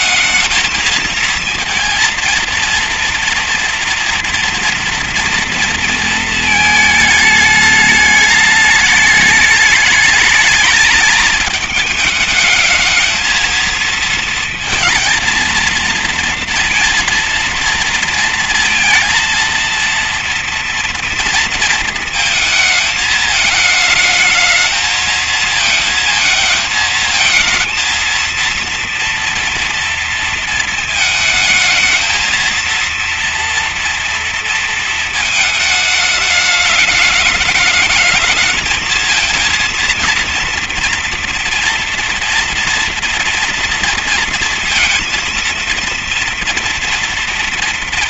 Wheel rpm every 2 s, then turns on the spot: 230, 230, 230, 220, 210, 220, 220, 230, 230, 230, 230, 220, 220, 220, 230, 220, 230, 230, 220, 230, 240, 230, 230, 230.
none